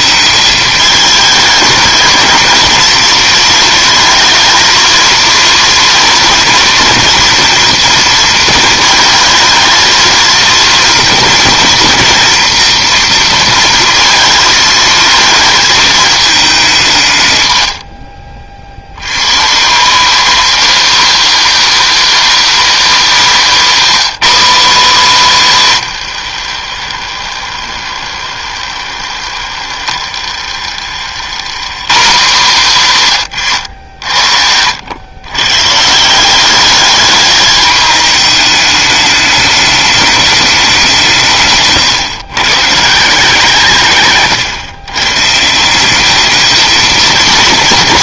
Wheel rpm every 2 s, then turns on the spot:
210, 230, 230, 230, 220, 230, 230, 220, 200, 70, 280, 320, 290, 70, 60, 70, 210, 90, 200, 210, 190, 150, 120, 220.
26-32